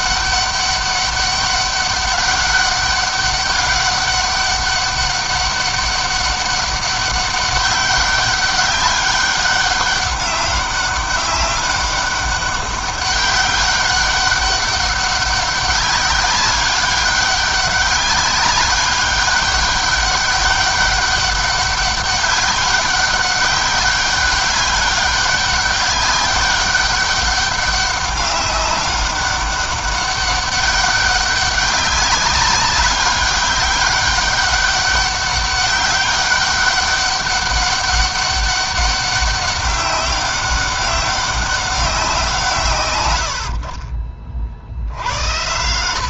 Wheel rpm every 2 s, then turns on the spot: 200, 200, 200, 200, 200, 200, 200, 200, 200, 200, 200, 200, 200, 200, 200, 200, 200, 200, 200, 200, 190, 130, 70.
none